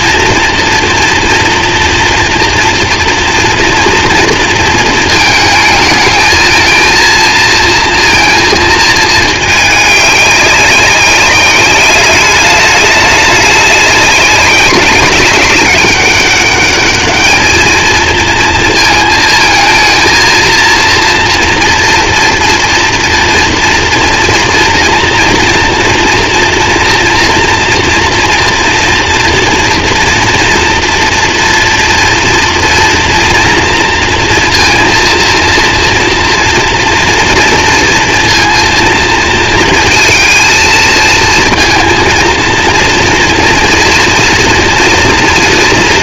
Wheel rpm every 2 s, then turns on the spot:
230, 230, 230, 230, 220, 200, 200, 190, 210, 220, 230, 240, 230, 230, 230, 230, 240, 230, 240, 230, 230, 230, 230.
none